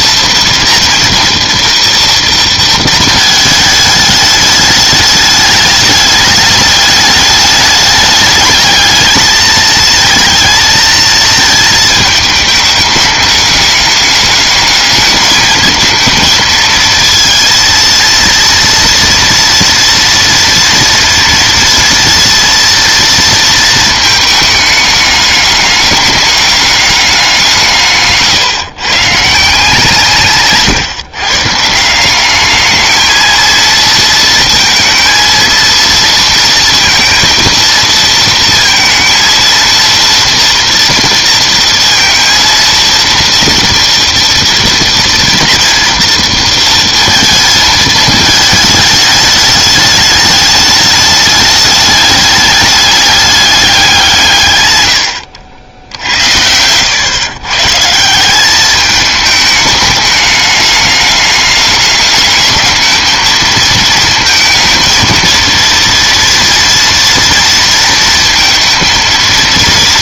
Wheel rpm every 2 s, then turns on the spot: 230, 230, 210, 210, 210, 230, 210, 210, 220, 230, 230, 230, 210, 200, 140, 140, 210, 230, 230, 220, 230, 230, 230, 230, 220, 210, 210, 130, 100, 200, 210, 210, 220, 230, 230.
none